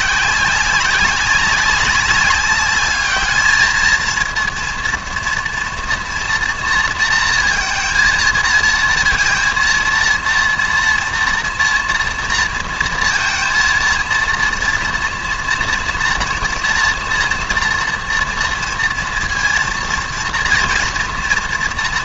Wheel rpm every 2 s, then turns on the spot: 190, 200, 230, 230, 230, 230, 230, 230, 230, 240, 230.
none